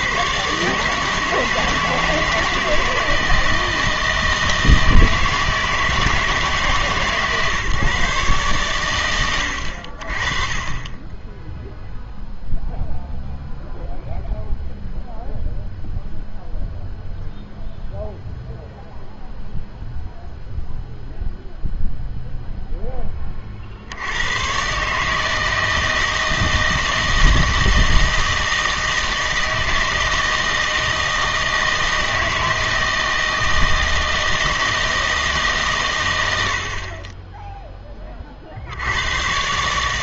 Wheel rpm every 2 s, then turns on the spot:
140, 160, 160, 150, 130, 30, 0, 0, 0, 0, 0, 0, 120, 160, 160, 160, 160, 160, 70, 60.
none